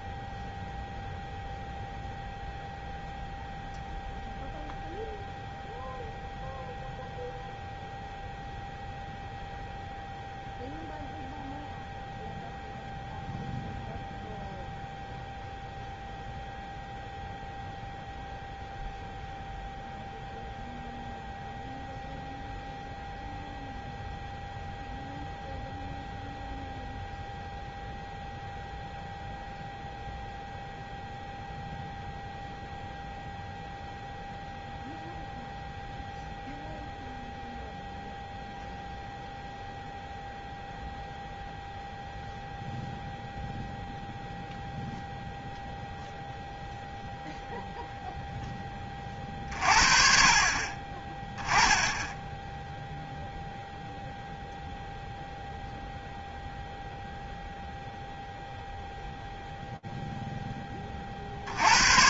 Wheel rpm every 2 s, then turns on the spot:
0, 0, 0, 0, 0, 0, 0, 0, 0, 0, 0, 0, 0, 0, 0, 0, 0, 0, 0, 0, 0, 0, 0, 0, 10, 30, 10, 0, 0, 0, 20.
none